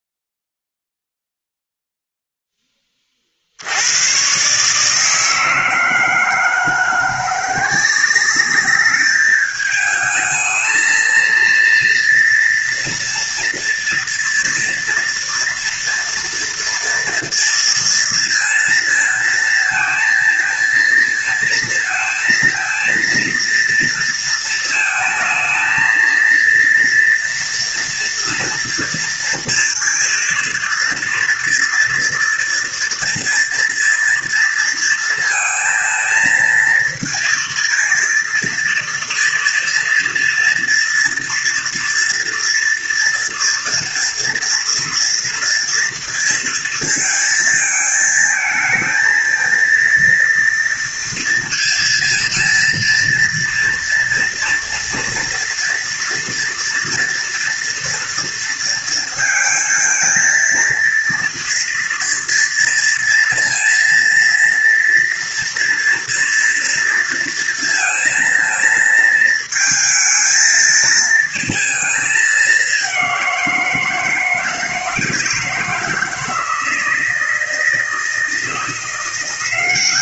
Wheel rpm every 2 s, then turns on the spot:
0, 40, 160, 170, 210, 230, 240, 230, 230, 230, 220, 230, 220, 230, 230, 230, 230, 230, 230, 230, 240, 230, 230, 220, 220, 230, 230, 230, 230, 230, 230, 230, 230, 230, 230, 230, 190, 160, 160, 180.
none